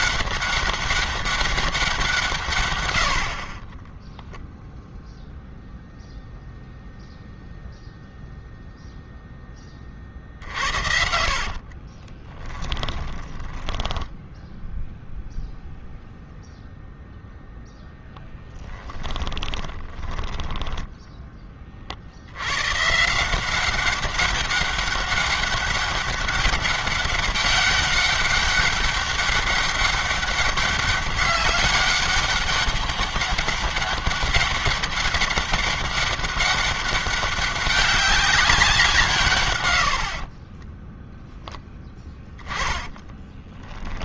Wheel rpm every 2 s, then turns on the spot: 200, 90, 0, 0, 0, 60, 20, 0, 0, 20, 10, 140, 200, 190, 200, 200, 200, 200, 200, 170, 10, 20.
10-14 18-20 42-44